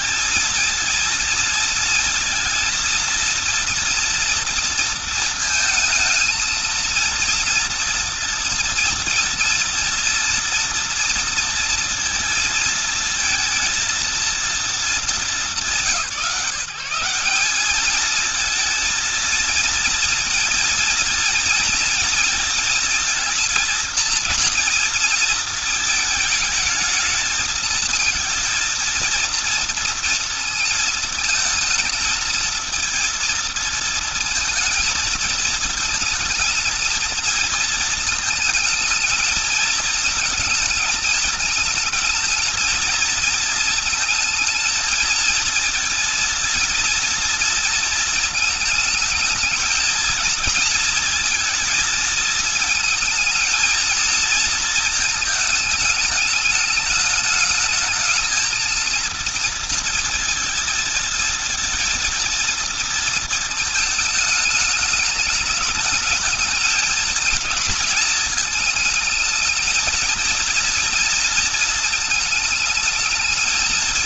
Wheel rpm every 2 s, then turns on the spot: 230, 230, 230, 230, 230, 230, 230, 230, 190, 230, 230, 230, 230, 220, 230, 230, 230, 220, 230, 220, 220, 220, 230, 230, 220, 230, 220, 220, 220, 220, 230, 230, 210, 230, 220, 230, 220.
none